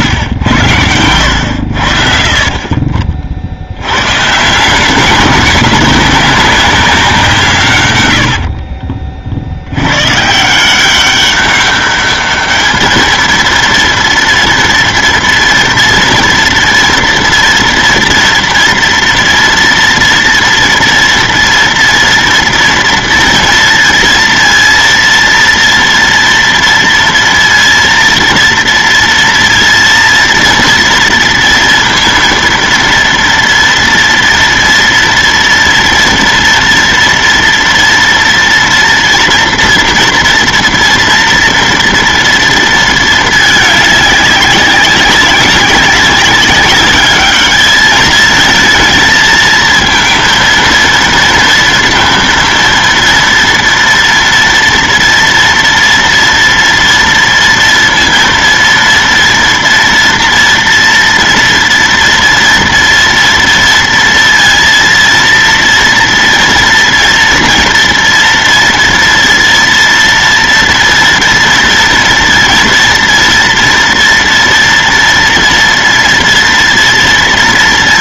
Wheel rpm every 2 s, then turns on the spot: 90, 30, 170, 190, 50, 170, 210, 230, 240, 230, 230, 230, 230, 230, 230, 230, 230, 230, 230, 230, 240, 230, 190, 200, 220, 230, 230, 230, 230, 230, 230, 230, 230, 240, 230, 240, 230, 230, 230.
8-10